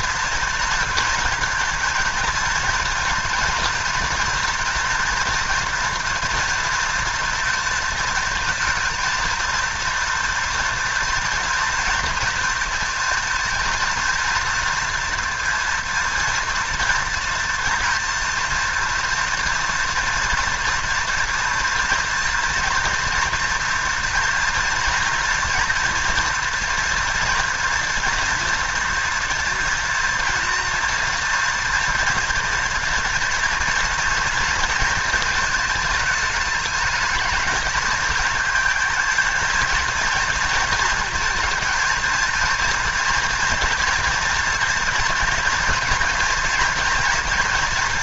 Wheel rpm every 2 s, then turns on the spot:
230, 230, 230, 230, 230, 230, 230, 230, 230, 230, 240, 230, 230, 230, 230, 230, 230, 230, 220, 220, 230, 230, 230, 240.
none